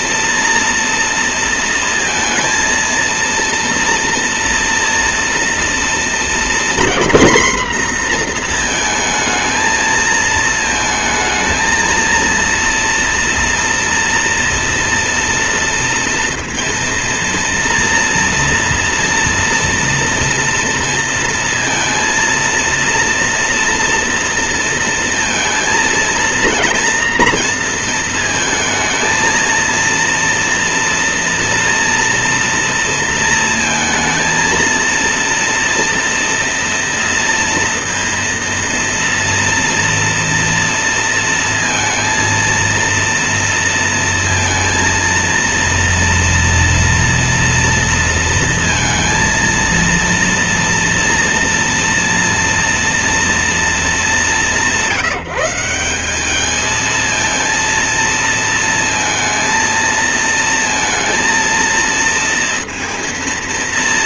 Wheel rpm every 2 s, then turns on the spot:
230, 230, 230, 240, 230, 220, 230, 230, 230, 230, 230, 230, 230, 230, 230, 230, 230, 230, 230, 230, 230, 230, 230, 230, 230, 230, 230, 160, 220, 230, 230, 230.
none